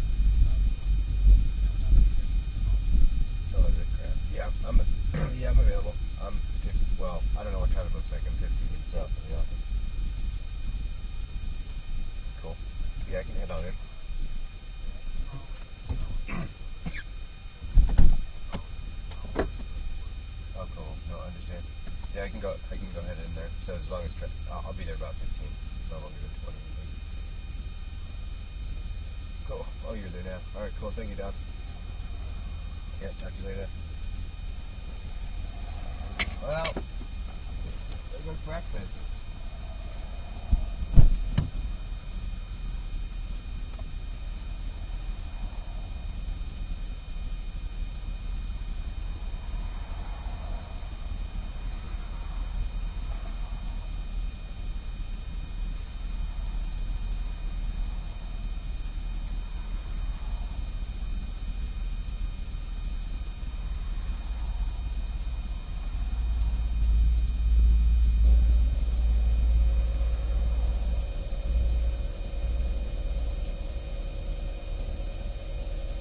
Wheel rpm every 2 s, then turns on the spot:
0, 0, 0, 0, 0, 0, 0, 0, 0, 0, 0, 0, 0, 0, 0, 0, 0, 0, 0, 0, 0, 0, 0, 0, 0, 0, 0, 0, 0, 0, 0, 0, 0, 0, 0, 0, 0, 0.
none